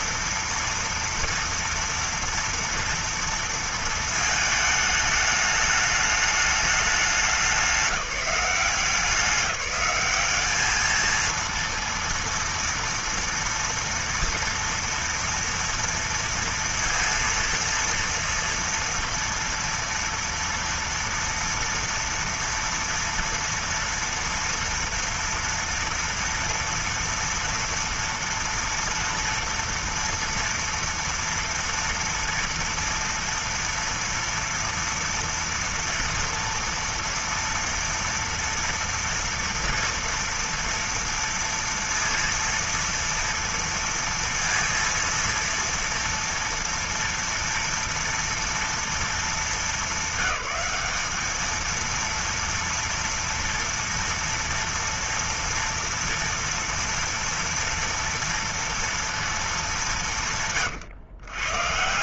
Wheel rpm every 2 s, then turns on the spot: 240, 230, 210, 200, 180, 220, 230, 230, 230, 230, 230, 230, 230, 230, 230, 230, 230, 230, 230, 230, 230, 230, 230, 230, 210, 200, 230, 230, 230, 230, 140.
none